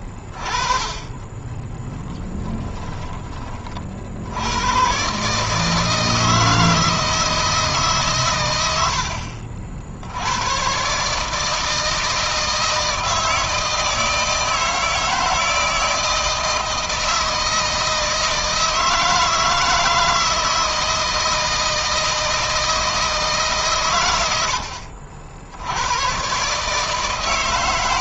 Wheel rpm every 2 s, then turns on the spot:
20, 20, 120, 160, 70, 140, 160, 160, 160, 160, 160, 160, 60, 160.
none